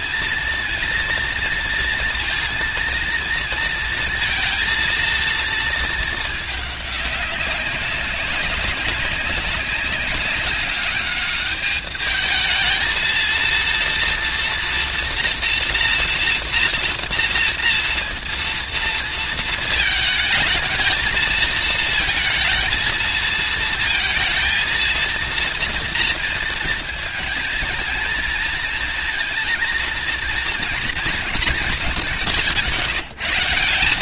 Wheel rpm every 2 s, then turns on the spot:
230, 220, 230, 220, 200, 200, 220, 230, 230, 230, 220, 220, 230, 220, 230, 230, 170.
none